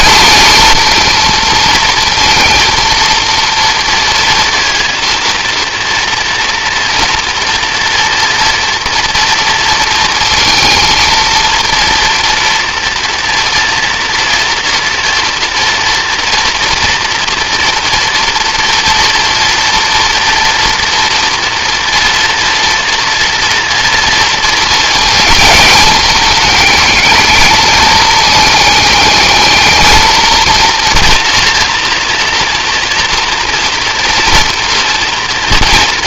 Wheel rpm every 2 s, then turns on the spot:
220, 230, 230, 240, 230, 230, 240, 230, 230, 230, 230, 240, 230, 210, 220, 230, 230, 240.
none